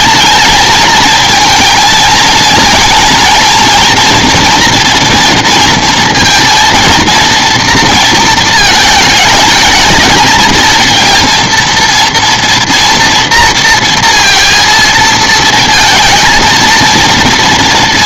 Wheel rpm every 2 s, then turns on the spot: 230, 220, 230, 230, 220, 220, 230, 230, 230.
none